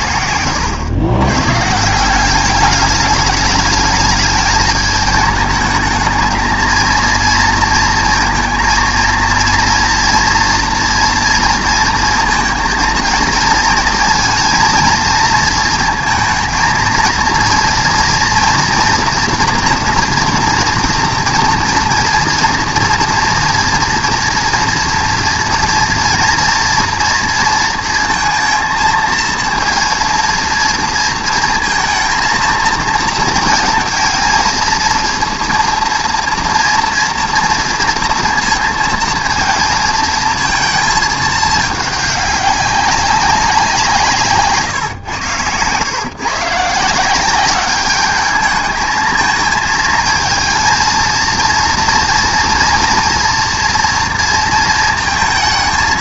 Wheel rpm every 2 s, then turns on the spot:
100, 200, 220, 220, 230, 230, 230, 230, 230, 230, 230, 230, 240, 230, 230, 230, 220, 230, 230, 230, 230, 200, 130, 140, 220, 230, 230, 230.
0-2